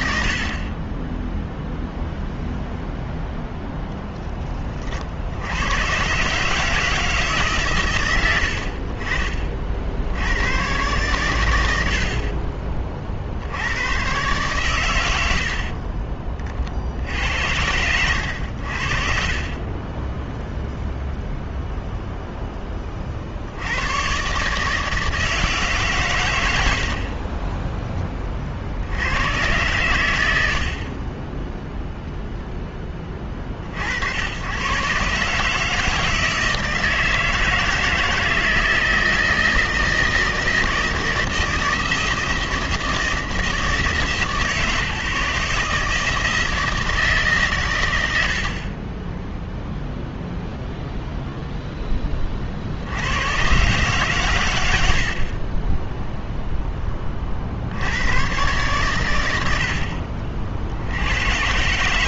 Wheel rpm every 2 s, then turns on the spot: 20, 0, 50, 160, 50, 120, 40, 110, 60, 60, 0, 10, 150, 90, 50, 60, 10, 100, 160, 160, 160, 160, 150, 160, 60, 0, 50, 100, 10, 120, 50.
none